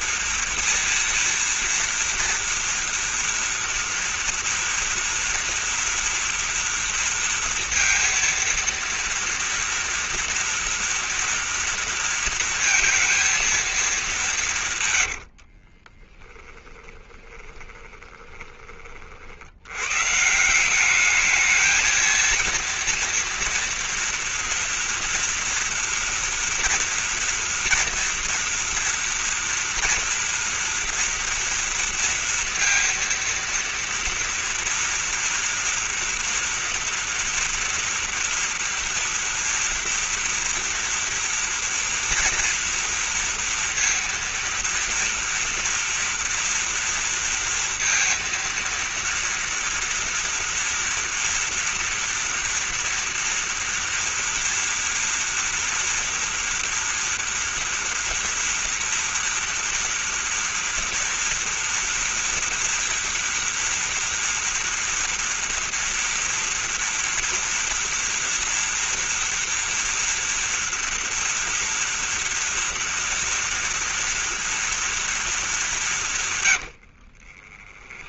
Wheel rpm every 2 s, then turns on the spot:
230, 230, 240, 230, 230, 230, 230, 140, 20, 30, 190, 230, 230, 230, 240, 230, 230, 230, 230, 230, 230, 230, 230, 230, 230, 230, 230, 230, 230, 230, 230, 240, 240, 230, 230, 230, 230, 230, 90.
14-18 76-78